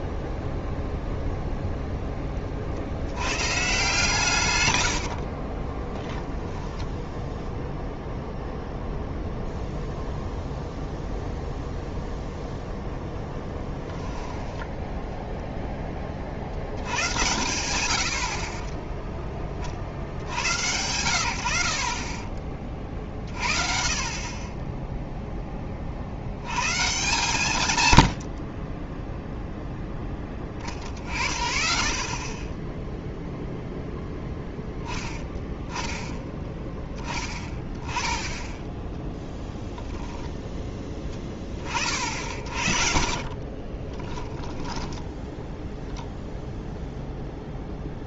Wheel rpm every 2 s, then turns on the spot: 0, 50, 100, 10, 0, 0, 0, 10, 80, 30, 100, 30, 20, 120, 30, 30, 10, 10, 10, 10, 10, 50, 10, 0.
4-6 14-16 28-30 42-46